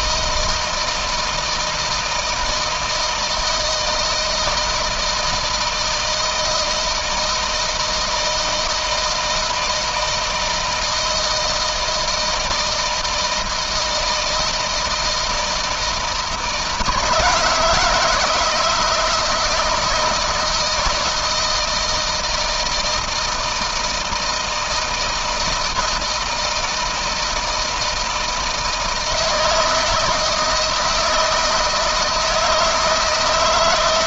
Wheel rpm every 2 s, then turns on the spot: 160, 160, 160, 160, 160, 160, 160, 160, 160, 160, 170, 160, 160, 160, 160, 160, 160.
none